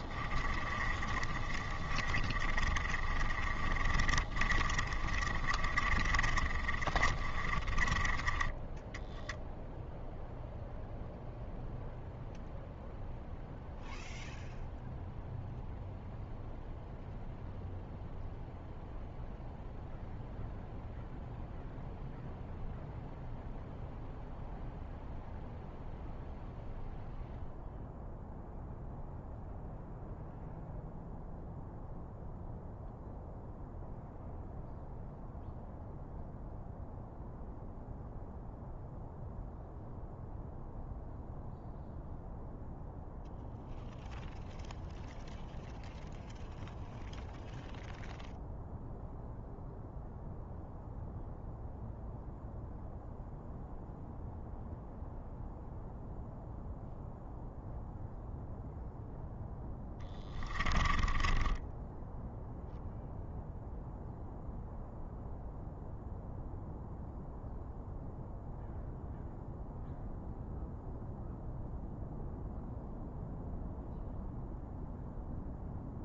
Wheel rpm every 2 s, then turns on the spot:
30, 30, 30, 30, 10, 0, 0, 0, 0, 0, 0, 0, 0, 0, 0, 0, 0, 0, 0, 0, 0, 0, 0, 0, 0, 0, 0, 0, 0, 0, 10, 0, 0, 0, 0, 0, 0, 0.
0-8 60-62